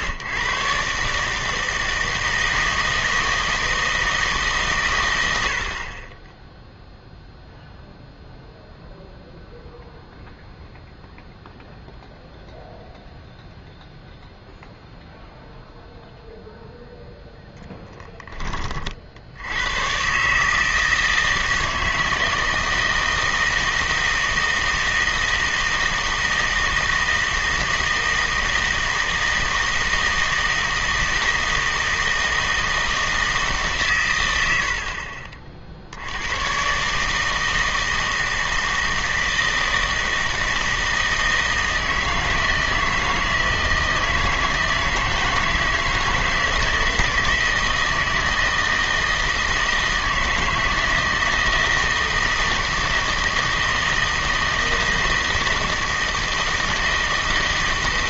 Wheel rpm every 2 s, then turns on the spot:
130, 160, 140, 0, 0, 0, 0, 0, 0, 30, 160, 160, 160, 160, 160, 160, 160, 60, 130, 160, 160, 160, 160, 160, 160, 160, 160, 160, 160.
none